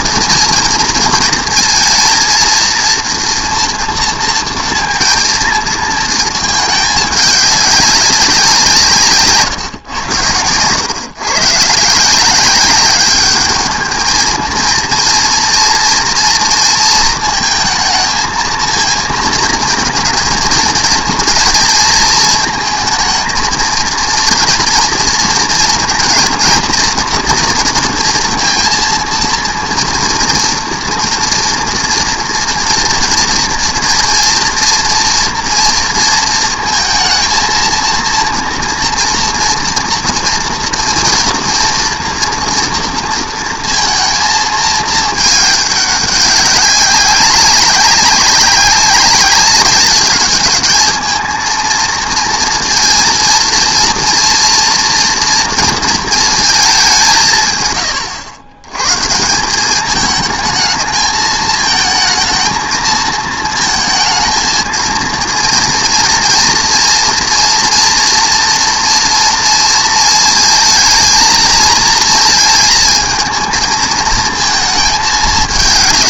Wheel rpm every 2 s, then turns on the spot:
230, 230, 220, 190, 110, 170, 220, 230, 220, 230, 230, 230, 230, 230, 230, 230, 230, 230, 230, 230, 230, 230, 200, 190, 200, 230, 230, 230, 100, 210, 220, 220, 230, 230, 230, 230, 230, 200.
none